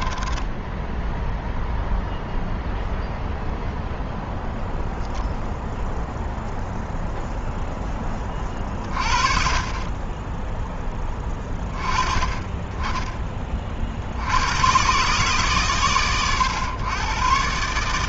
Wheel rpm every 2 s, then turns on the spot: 10, 0, 0, 0, 20, 10, 20, 80, 100.
0-2